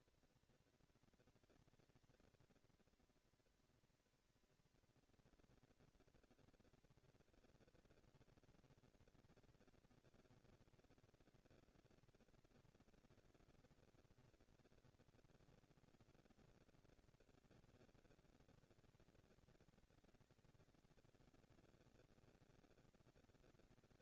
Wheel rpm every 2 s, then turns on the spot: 230, 240, 230, 230, 230, 230, 230, 240, 220, 190, 200, 220.
none